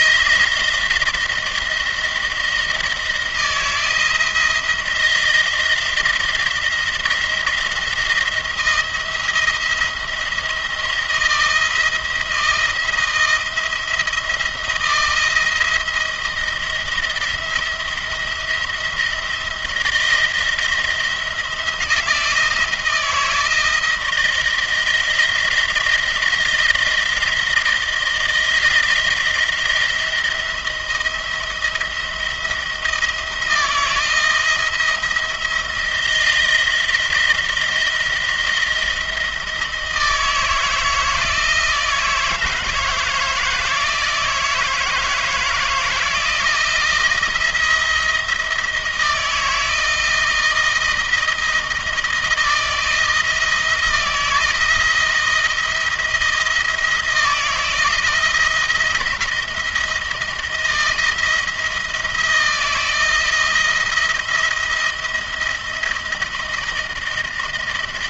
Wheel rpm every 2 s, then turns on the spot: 170, 160, 160, 170, 170, 170, 160, 170, 170, 170, 160, 160, 170, 160, 170, 170, 160, 160, 170, 170, 160, 160, 160, 170, 170, 160, 160, 170, 170, 170, 170, 170, 170, 170.
none